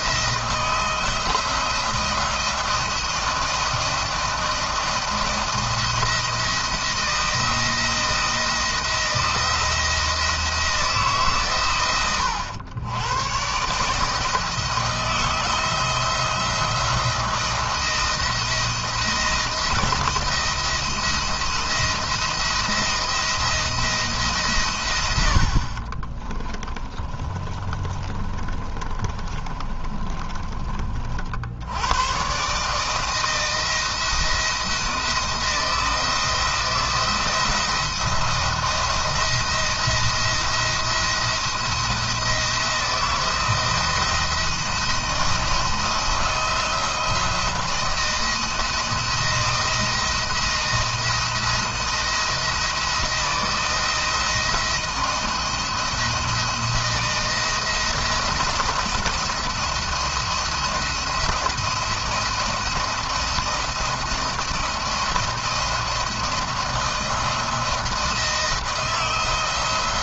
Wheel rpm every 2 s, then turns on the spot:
160, 170, 170, 170, 170, 160, 110, 160, 170, 170, 160, 170, 120, 20, 30, 30, 140, 160, 170, 170, 170, 160, 160, 170, 170, 160, 170, 170, 170, 170, 170, 170, 170, 160, 160.
26-30